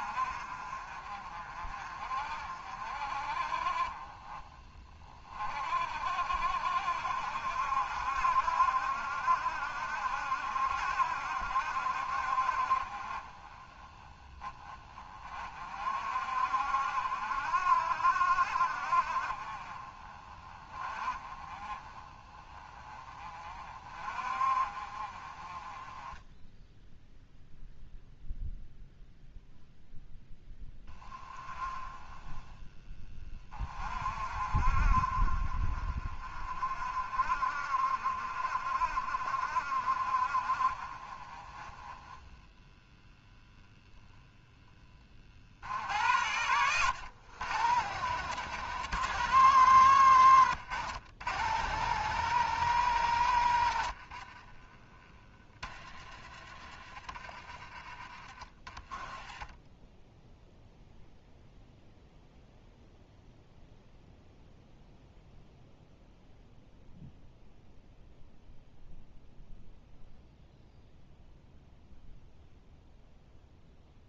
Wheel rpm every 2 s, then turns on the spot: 40, 40, 30, 70, 70, 70, 40, 40, 60, 50, 30, 20, 30, 0, 0, 10, 20, 40, 40, 50, 30, 0, 30, 110, 150, 120, 140, 20, 40, 20, 0, 0, 0, 0, 0, 0, 0.
none